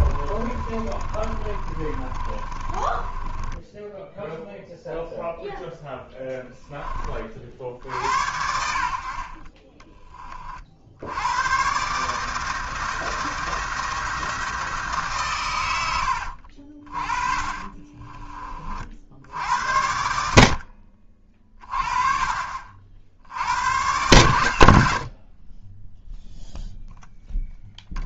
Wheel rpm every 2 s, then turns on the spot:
30, 20, 0, 20, 50, 60, 160, 150, 50, 40, 60, 50, 80, 0.
0-4 16-18